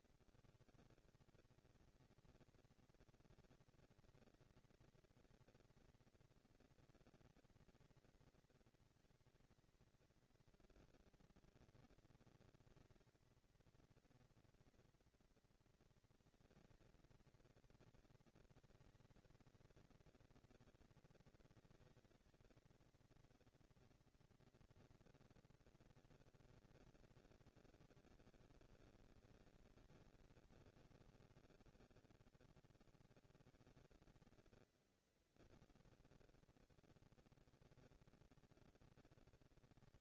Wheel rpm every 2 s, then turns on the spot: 180, 230, 230, 230, 220, 230, 230, 230, 230, 230, 230, 230, 230, 230, 220, 200, 210, 230, 230, 230.
none